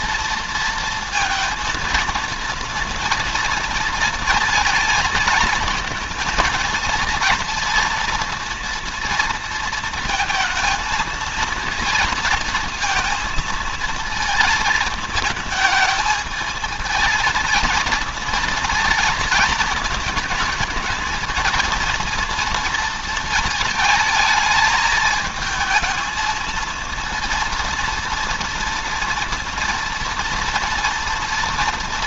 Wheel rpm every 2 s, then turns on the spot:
220, 230, 220, 220, 230, 230, 230, 220, 220, 230, 220, 220, 220, 230, 230, 230.
none